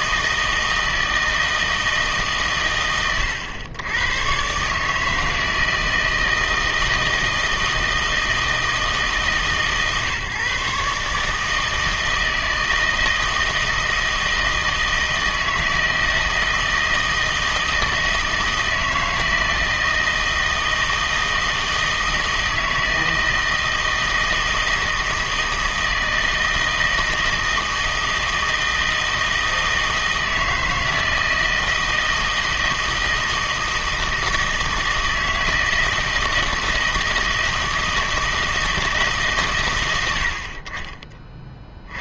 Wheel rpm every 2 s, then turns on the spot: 160, 130, 130, 160, 160, 140, 160, 160, 160, 160, 160, 160, 160, 160, 160, 160, 160, 160, 160, 160, 50.
none